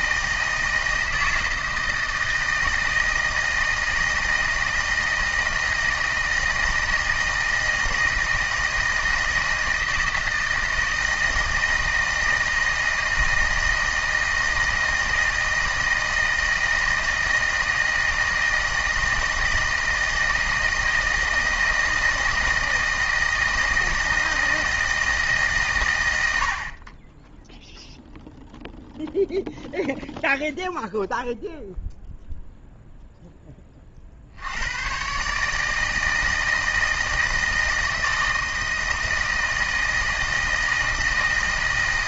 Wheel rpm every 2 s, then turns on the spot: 160, 160, 160, 160, 160, 160, 160, 160, 160, 160, 160, 160, 160, 40, 0, 0, 0, 110, 160, 160, 160.
none